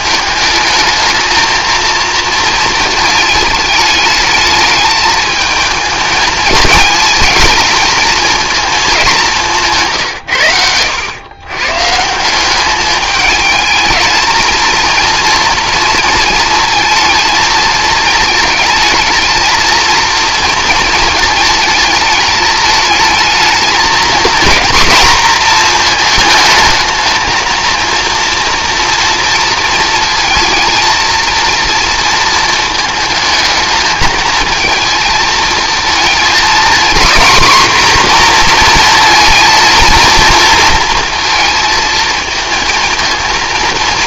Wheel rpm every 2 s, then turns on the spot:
210, 230, 210, 220, 220, 100, 200, 230, 230, 220, 230, 220, 230, 220, 230, 230, 220, 220, 240, 240, 230, 220.
10-12